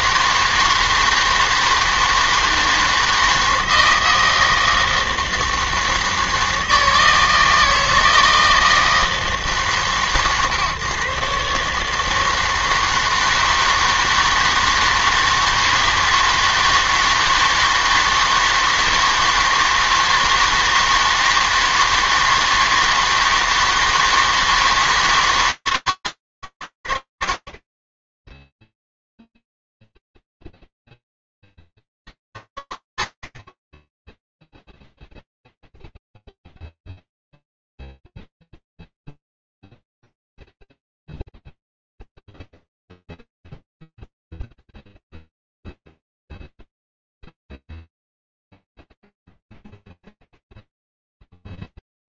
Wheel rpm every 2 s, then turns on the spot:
160, 160, 160, 160, 160, 130, 160, 160, 160, 160, 160, 160, 160, 80, 10, 0, 70, 0, 0, 0, 0, 0, 0, 0, 0, 0.
none